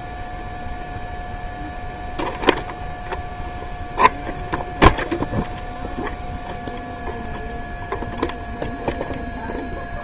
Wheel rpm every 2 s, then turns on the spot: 0, 0, 0, 0, 0.
none